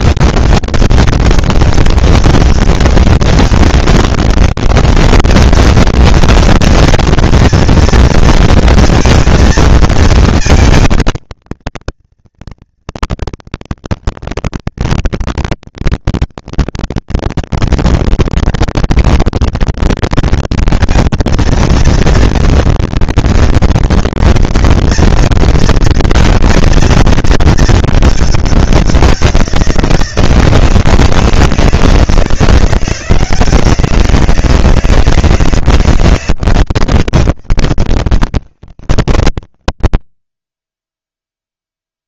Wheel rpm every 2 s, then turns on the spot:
200, 200, 200, 220, 230, 230, 230, 230, 230, 230, 230, 230, 230, 220, 190, 160, 170, 160, 160, 110, 20.
none